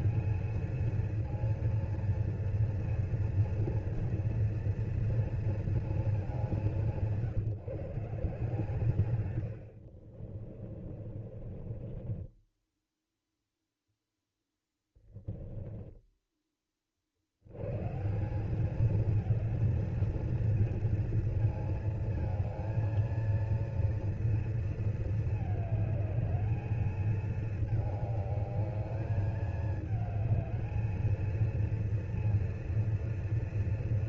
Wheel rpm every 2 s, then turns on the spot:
220, 230, 230, 200, 170, 50, 10, 10, 30, 200, 220, 220, 230, 210, 210, 210, 230.
10-16